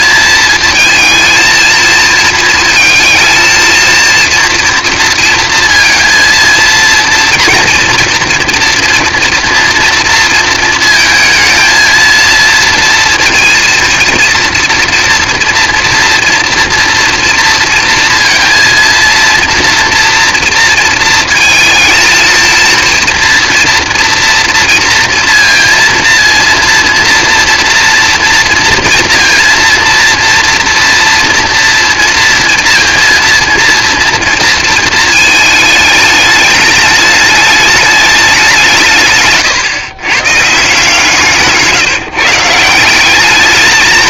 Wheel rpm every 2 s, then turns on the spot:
220, 230, 230, 230, 230, 230, 230, 230, 230, 230, 230, 230, 230, 230, 230, 230, 230, 220, 210, 140, 160, 200.
40-42